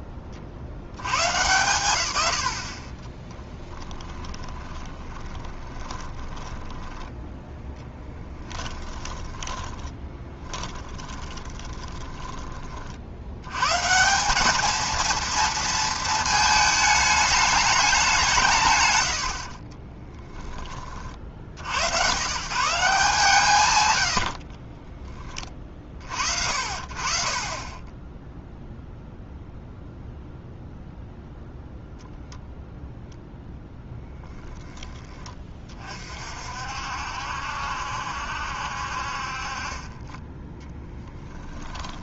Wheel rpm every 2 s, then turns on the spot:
90, 40, 20, 10, 20, 20, 40, 220, 220, 110, 40, 150, 20, 50, 0, 0, 0, 10, 60, 60, 20.
4-12 24-26 40-42